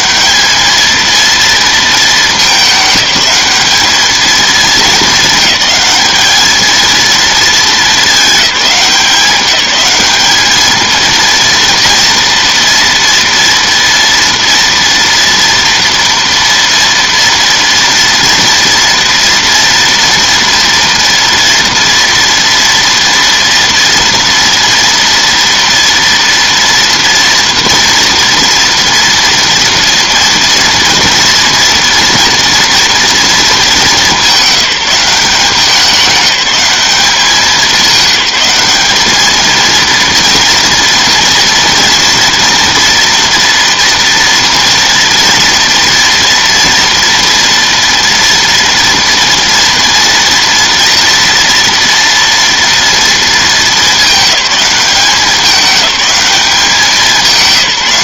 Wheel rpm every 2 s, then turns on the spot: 220, 210, 220, 220, 190, 220, 230, 240, 230, 230, 230, 230, 230, 230, 240, 230, 230, 190, 190, 200, 240, 230, 230, 230, 230, 230, 230, 200, 190.
none